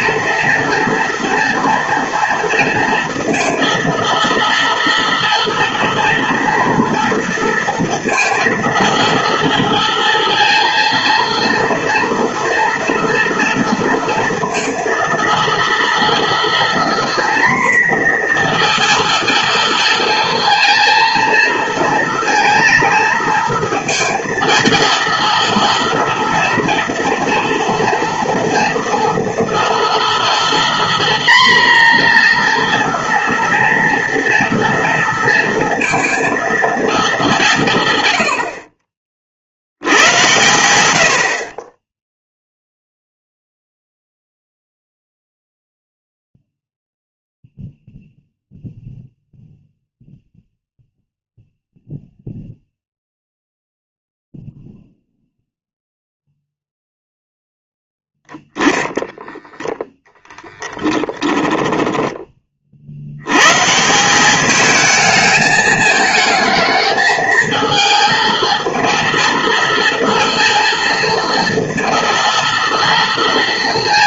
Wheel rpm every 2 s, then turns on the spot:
230, 230, 230, 230, 230, 230, 230, 230, 240, 240, 230, 230, 230, 230, 230, 240, 240, 230, 230, 50, 90, 0, 0, 0, 0, 0, 0, 0, 0, 10, 10, 40, 210, 220, 230, 230, 230.
58-62